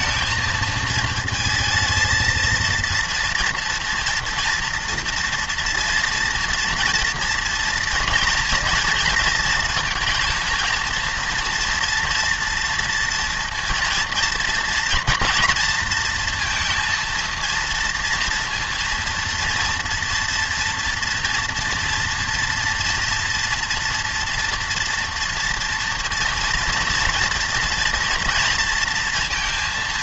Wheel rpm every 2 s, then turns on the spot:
220, 230, 230, 230, 230, 230, 230, 240, 230, 230, 230, 230, 230, 240, 230.
none